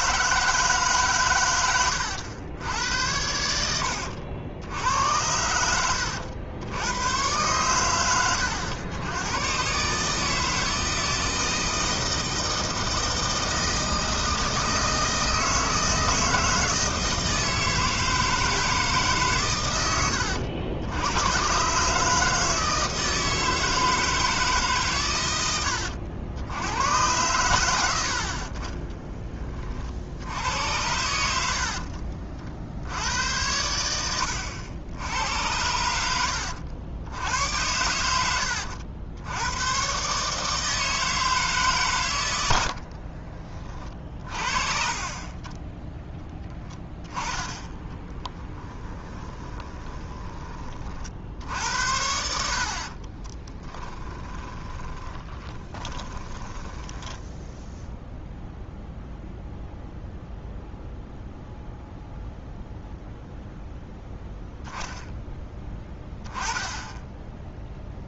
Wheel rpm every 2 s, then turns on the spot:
150, 90, 80, 80, 90, 160, 160, 160, 160, 160, 90, 160, 140, 90, 20, 90, 70, 90, 80, 90, 160, 80, 30, 10, 10, 30, 50, 10, 10, 0, 0, 0, 0, 10.
42-44 48-50 52-58